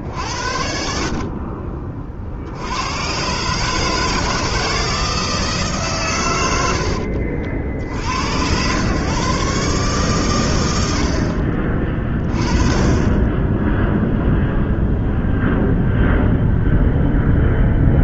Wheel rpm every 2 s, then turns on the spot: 50, 100, 170, 80, 120, 80, 20, 0, 0.
none